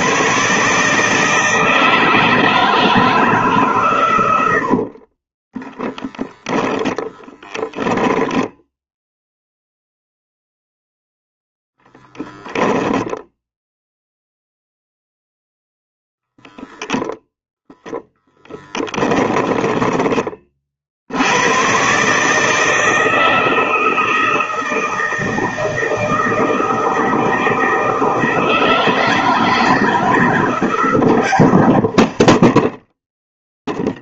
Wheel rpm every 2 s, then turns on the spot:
160, 160, 40, 10, 10, 0, 0, 0, 0, 30, 80, 160, 160, 160, 160, 150, 10.
4-6 18-20 32-34